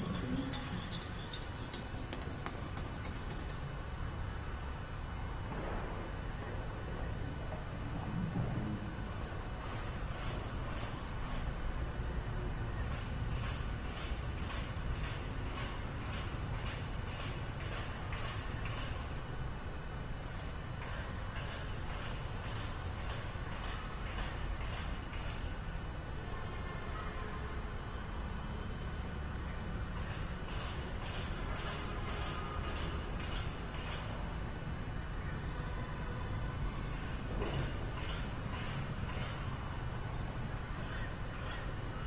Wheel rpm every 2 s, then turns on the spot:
0, 0, 0, 0, 0, 0, 0, 0, 0, 0, 0, 0, 0, 0, 0, 0, 0, 0, 0, 0, 0.
none